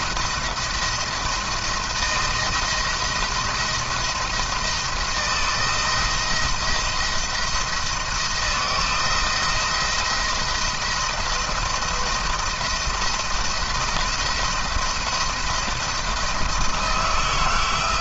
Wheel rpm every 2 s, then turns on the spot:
170, 170, 170, 170, 160, 170, 170, 170, 160.
none